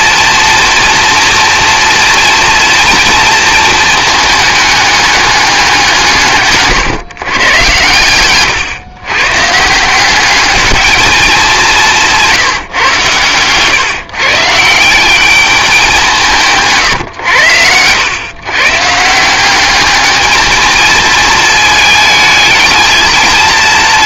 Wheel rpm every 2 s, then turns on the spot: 230, 230, 210, 140, 120, 210, 130, 160, 150, 140, 220, 220.
none